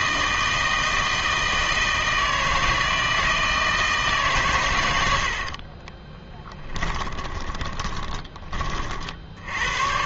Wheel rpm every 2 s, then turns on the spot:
160, 160, 100, 10, 40.
6-8